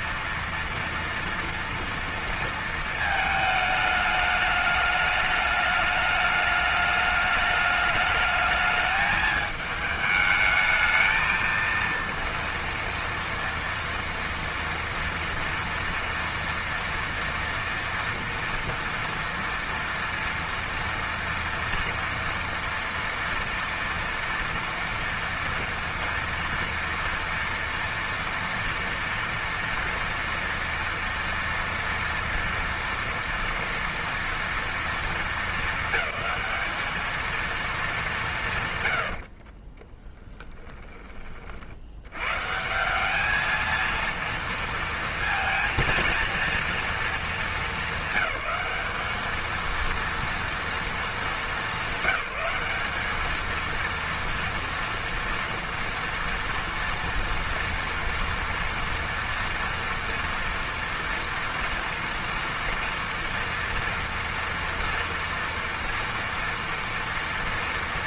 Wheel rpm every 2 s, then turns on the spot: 230, 220, 210, 210, 210, 220, 240, 230, 230, 230, 230, 230, 240, 230, 230, 230, 230, 230, 220, 110, 20, 180, 230, 230, 210, 230, 200, 230, 230, 230, 230, 230, 230, 230.
none